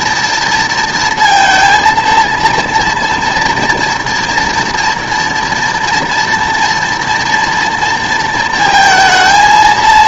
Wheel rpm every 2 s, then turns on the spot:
230, 230, 240, 230, 220.
none